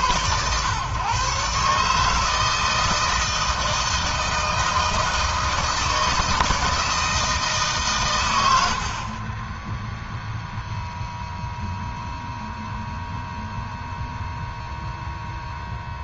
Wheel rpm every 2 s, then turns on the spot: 140, 160, 160, 160, 40, 0, 0, 0.
none